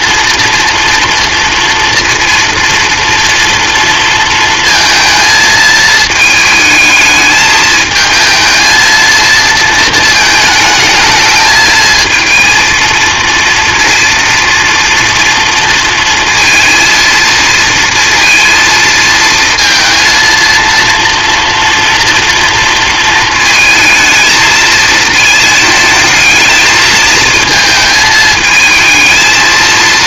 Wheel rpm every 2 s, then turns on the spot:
240, 230, 220, 220, 220, 220, 230, 230, 230, 230, 230, 230, 220, 220, 220.
none